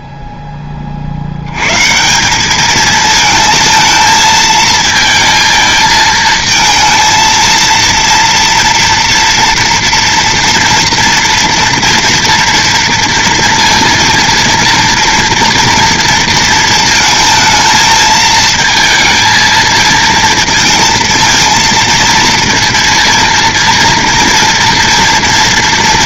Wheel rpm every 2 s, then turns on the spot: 40, 220, 220, 230, 230, 230, 230, 230, 220, 220, 230, 230, 230.
none